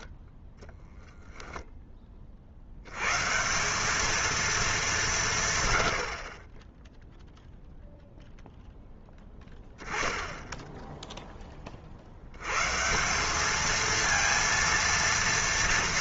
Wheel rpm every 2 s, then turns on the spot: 10, 70, 220, 20, 0, 10, 130, 230.
none